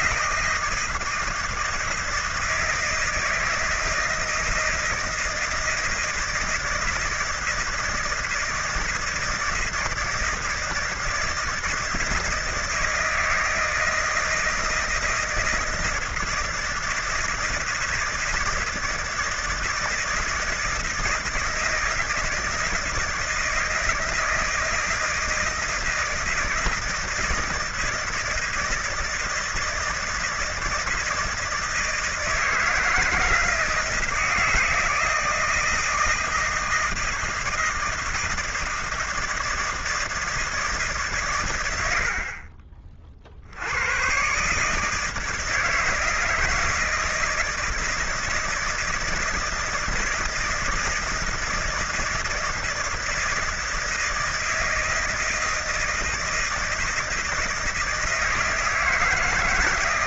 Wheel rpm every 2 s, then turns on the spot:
160, 160, 160, 160, 160, 160, 160, 160, 160, 160, 160, 160, 160, 160, 160, 170, 160, 160, 160, 160, 160, 50, 140, 160, 160, 160, 160, 160, 160, 160.
none